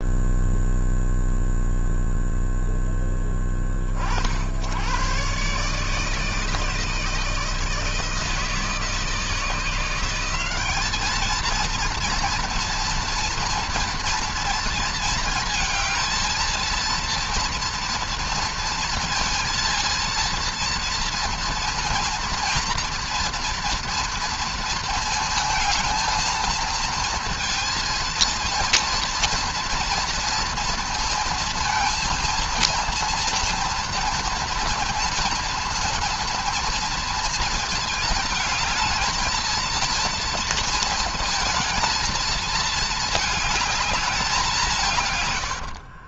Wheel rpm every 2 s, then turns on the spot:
0, 10, 110, 160, 160, 210, 230, 230, 230, 230, 230, 230, 230, 230, 230, 230, 230, 230, 230, 220, 230, 220, 160.
none